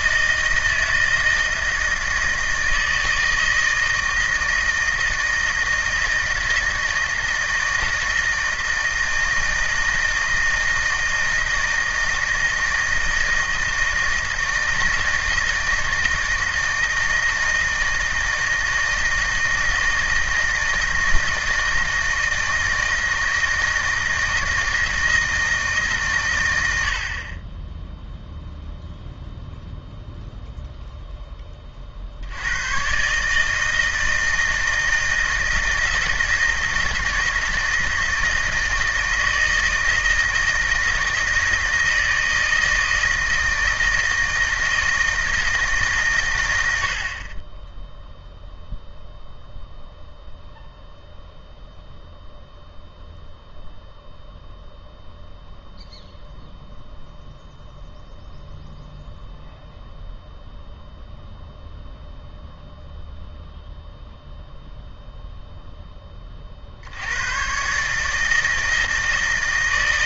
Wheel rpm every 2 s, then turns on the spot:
160, 160, 160, 160, 160, 160, 160, 160, 160, 160, 160, 160, 160, 90, 0, 0, 110, 160, 160, 160, 160, 160, 160, 90, 0, 0, 0, 0, 0, 0, 0, 0, 0, 50, 160.
none